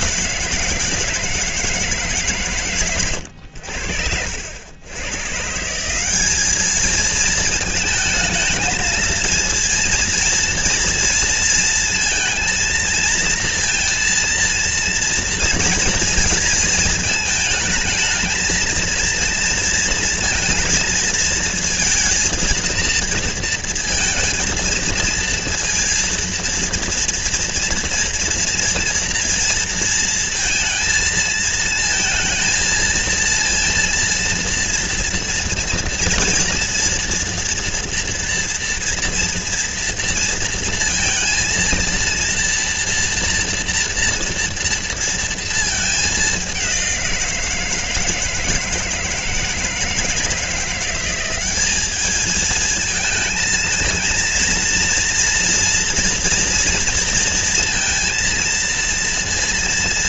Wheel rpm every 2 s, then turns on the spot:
150, 110, 110, 220, 230, 230, 230, 230, 230, 230, 220, 230, 230, 230, 240, 230, 230, 230, 230, 230, 230, 230, 230, 180, 160, 180, 220, 230, 240, 230.
none